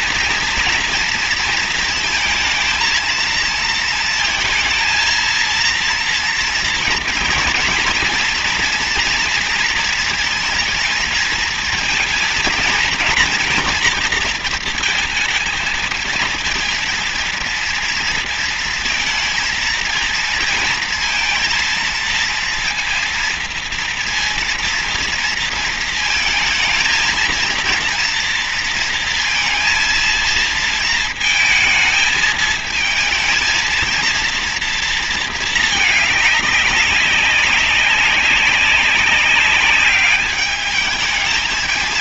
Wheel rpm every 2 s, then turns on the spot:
240, 220, 230, 230, 240, 230, 230, 230, 220, 230, 230, 230, 230, 230, 230, 230, 220, 230, 200, 190, 210.
none